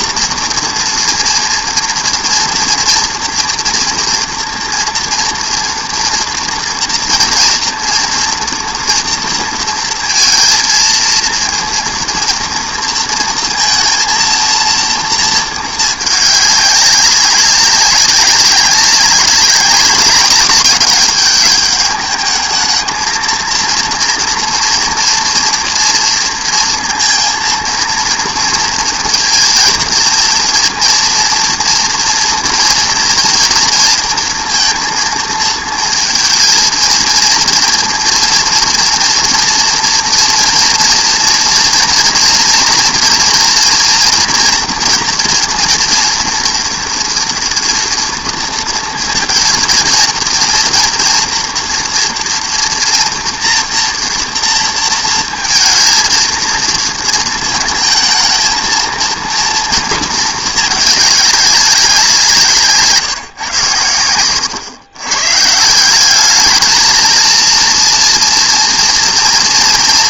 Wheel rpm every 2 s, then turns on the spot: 230, 230, 230, 230, 240, 230, 230, 230, 200, 200, 210, 210, 230, 230, 230, 230, 230, 230, 230, 240, 240, 230, 240, 240, 230, 230, 230, 230, 230, 220, 220, 160, 110, 210, 230.
none